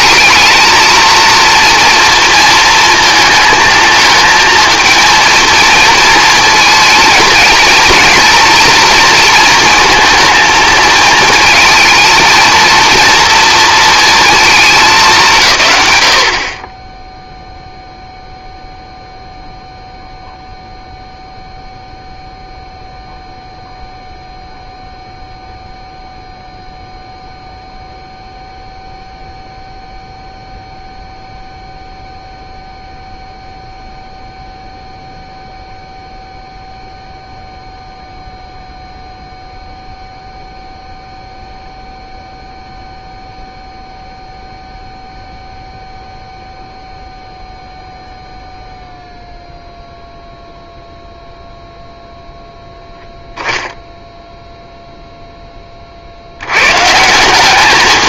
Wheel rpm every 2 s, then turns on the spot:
220, 230, 230, 220, 230, 230, 230, 220, 30, 0, 0, 0, 0, 0, 0, 0, 0, 0, 0, 0, 0, 0, 0, 0, 0, 0, 0, 0, 120.
none